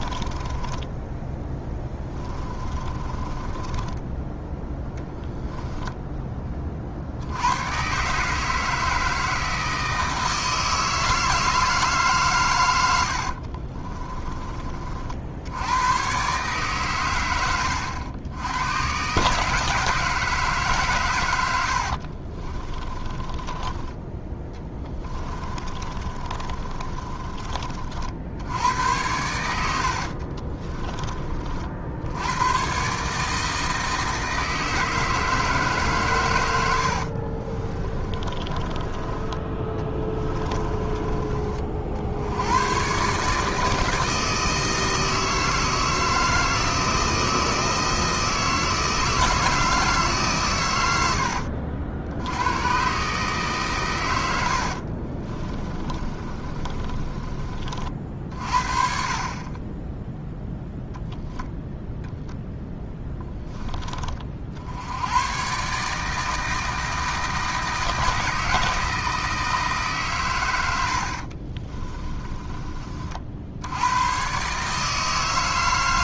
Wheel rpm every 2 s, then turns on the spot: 10, 20, 10, 40, 160, 160, 90, 30, 100, 120, 140, 20, 20, 30, 90, 30, 130, 160, 80, 20, 30, 110, 160, 160, 160, 100, 120, 60, 30, 50, 0, 0, 80, 160, 160, 80, 40, 150.
0-4 12-14 22-28 30-32 36-42 54-58 70-72